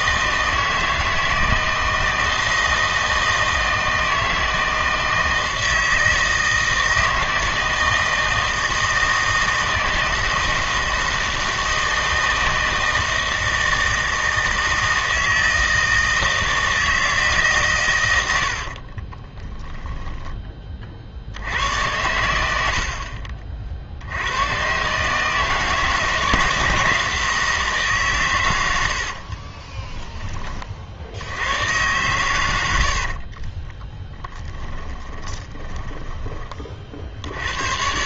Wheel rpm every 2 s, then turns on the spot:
160, 160, 160, 160, 160, 160, 160, 160, 160, 70, 30, 80, 120, 160, 100, 40, 90, 20, 30.
18-20 22-24 32-36